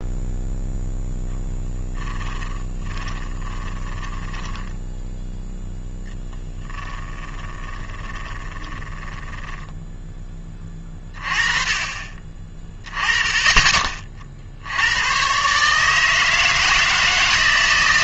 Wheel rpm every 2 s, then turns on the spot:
0, 20, 10, 10, 10, 20, 30, 80, 160.
2-10